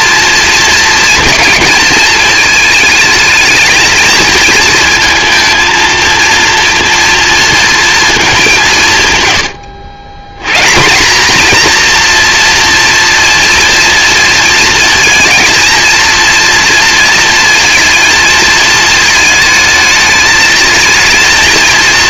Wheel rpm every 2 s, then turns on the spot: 230, 220, 220, 230, 160, 190, 240, 230, 230, 220, 220.
none